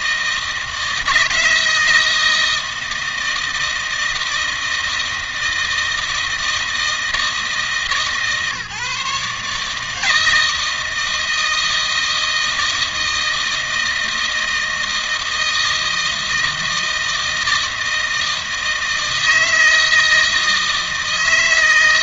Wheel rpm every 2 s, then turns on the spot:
160, 170, 160, 160, 150, 160, 160, 160, 160, 160, 160.
none